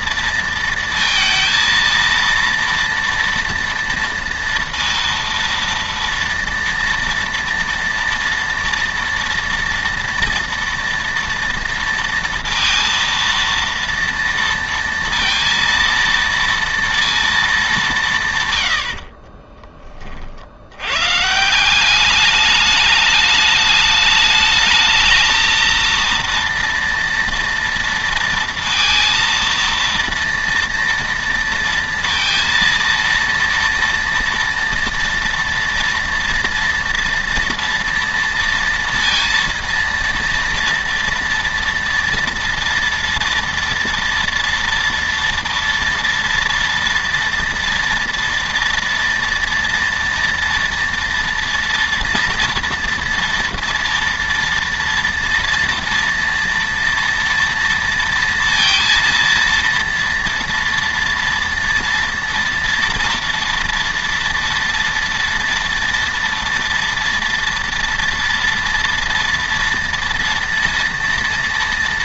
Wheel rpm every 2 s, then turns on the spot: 230, 230, 230, 230, 230, 230, 230, 230, 230, 100, 80, 210, 220, 230, 230, 230, 230, 230, 230, 230, 230, 230, 230, 230, 230, 230, 230, 230, 230, 230, 230, 230, 230, 230, 240, 230.
none